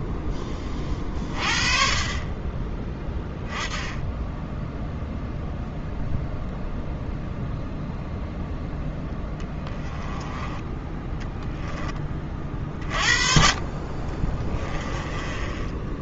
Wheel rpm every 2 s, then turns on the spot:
30, 20, 0, 0, 10, 20, 30, 20.
14-16